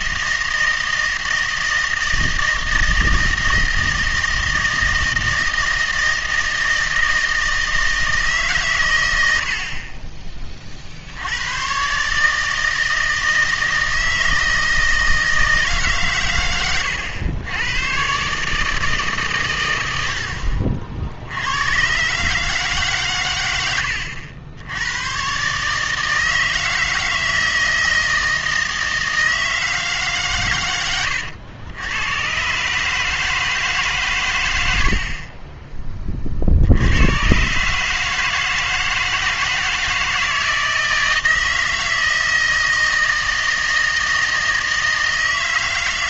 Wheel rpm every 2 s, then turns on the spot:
160, 160, 160, 160, 120, 30, 160, 160, 110, 150, 50, 140, 90, 160, 160, 110, 140, 90, 80, 160, 160, 160, 160.
none